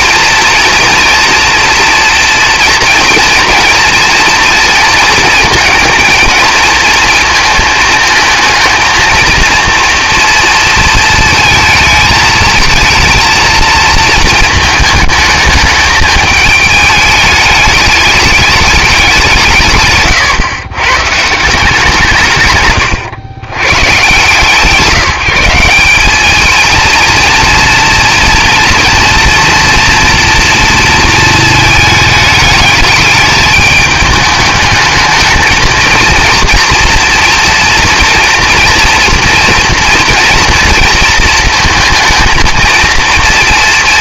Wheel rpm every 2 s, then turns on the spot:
230, 230, 230, 230, 220, 230, 230, 220, 210, 210, 120, 140, 140, 220, 240, 230, 210, 210, 230, 240, 230, 230.
none